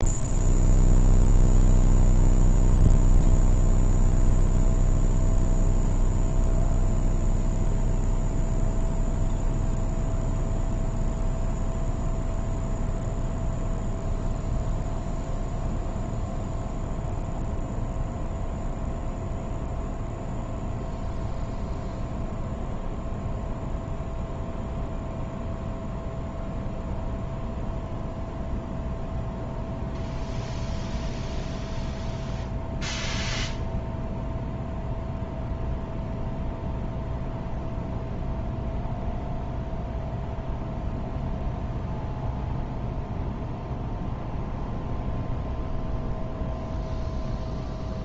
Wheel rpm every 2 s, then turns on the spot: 0, 0, 0, 0, 0, 0, 0, 0, 0, 0, 0, 0, 0, 0, 0, 0, 0, 0, 0, 0, 0, 0, 0, 0.
none